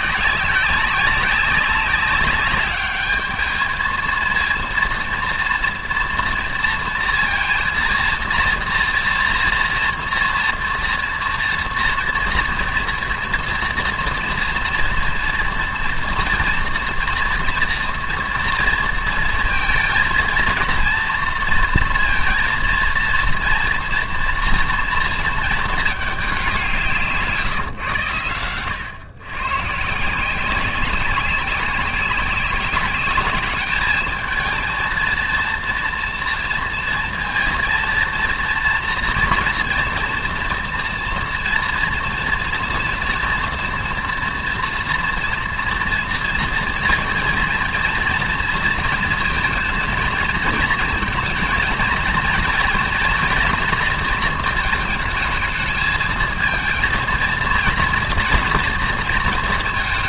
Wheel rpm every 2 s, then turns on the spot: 190, 200, 230, 230, 230, 230, 230, 230, 230, 230, 220, 230, 230, 190, 100, 180, 200, 220, 230, 230, 230, 230, 230, 230, 230, 230, 230, 230, 230, 230.
none